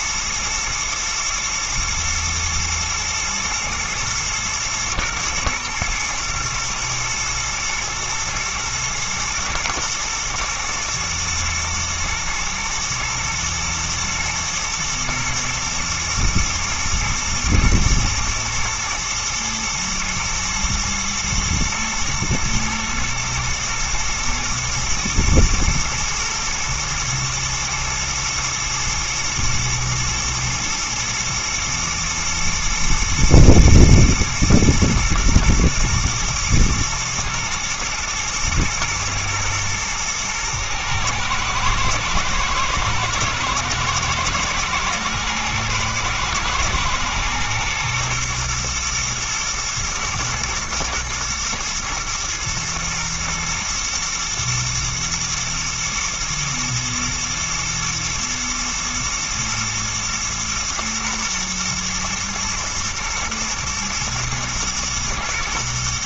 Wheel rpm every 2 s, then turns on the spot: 110, 110, 110, 110, 110, 110, 110, 120, 120, 120, 120, 120, 110, 110, 110, 110, 110, 110, 120, 120, 120, 120, 110, 120, 120, 120, 120, 110, 120, 120, 120, 120, 120.
none